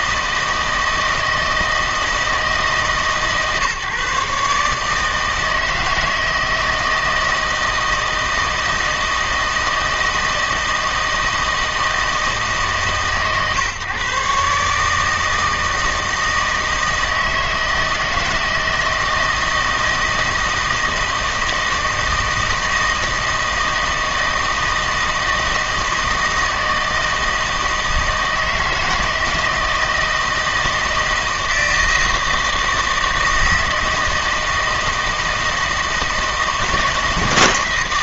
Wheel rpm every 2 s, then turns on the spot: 160, 160, 150, 160, 160, 160, 150, 150, 160, 160, 160, 160, 160, 160, 160, 160, 160, 160, 160.
none